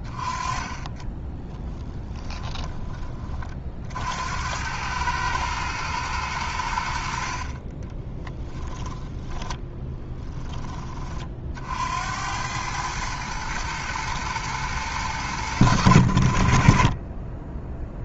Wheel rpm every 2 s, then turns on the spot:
20, 30, 100, 90, 10, 20, 110, 100, 30.
2-4